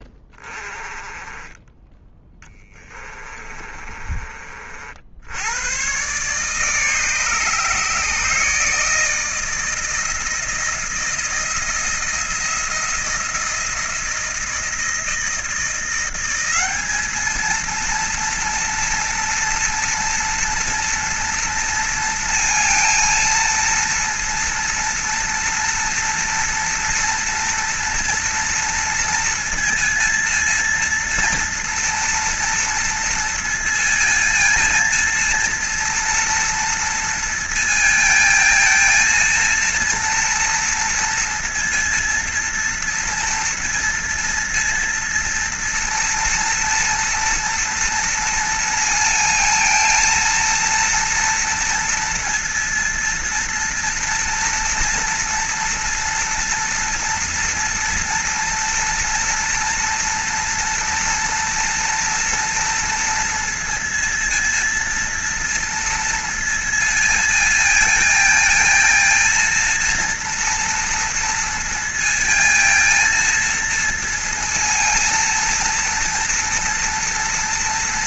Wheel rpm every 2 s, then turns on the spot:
20, 20, 60, 150, 160, 170, 170, 160, 210, 240, 230, 230, 230, 230, 230, 230, 230, 230, 230, 230, 230, 230, 230, 230, 220, 230, 230, 230, 240, 230, 230, 230, 230, 230, 230, 230, 230, 230, 230.
2-4